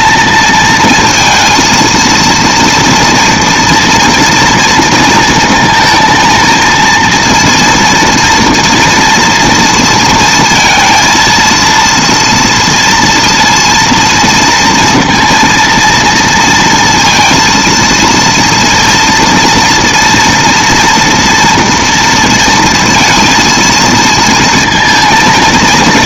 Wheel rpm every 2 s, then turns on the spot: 220, 230, 230, 230, 230, 230, 230, 230, 230, 230, 230, 230, 230.
none